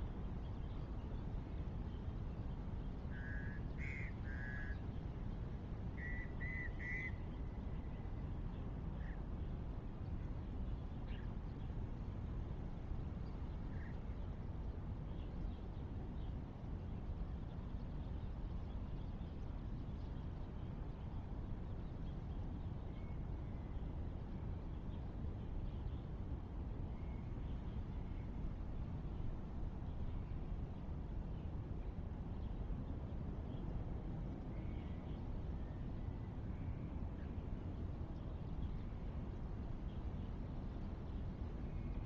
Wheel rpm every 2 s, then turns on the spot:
0, 0, 0, 0, 0, 0, 0, 0, 0, 0, 0, 0, 0, 0, 0, 0, 0, 0, 0, 0, 0.
none